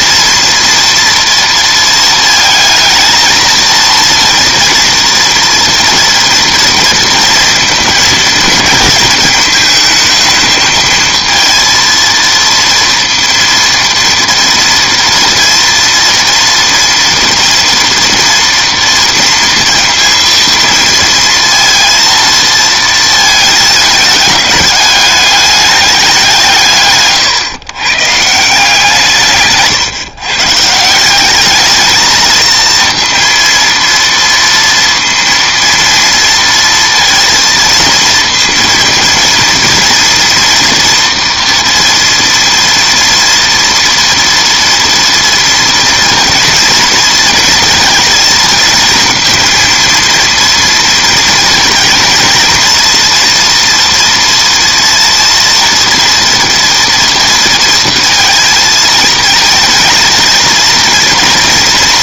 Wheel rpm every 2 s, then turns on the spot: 230, 220, 230, 230, 220, 220, 230, 230, 230, 230, 230, 220, 210, 150, 160, 150, 230, 230, 230, 230, 230, 230, 230, 230, 230, 230, 230, 230, 230, 220, 230.
none